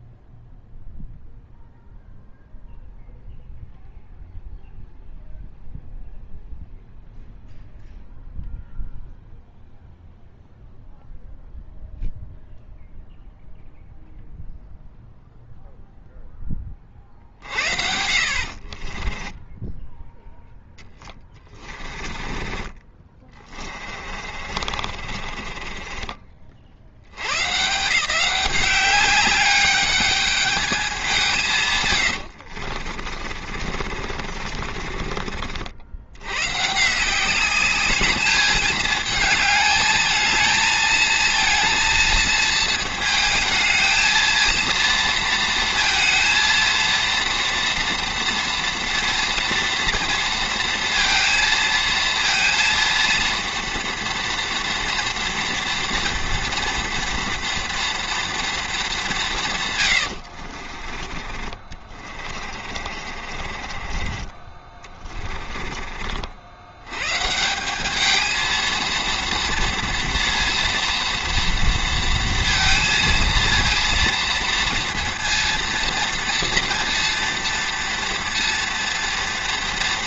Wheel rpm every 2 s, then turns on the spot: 0, 0, 0, 0, 0, 0, 0, 0, 20, 40, 10, 30, 50, 50, 200, 210, 50, 40, 140, 210, 220, 230, 230, 230, 230, 230, 230, 240, 230, 220, 50, 40, 30, 90, 230, 230, 230, 230, 230, 230.
18-20 24-26 32-36 60-66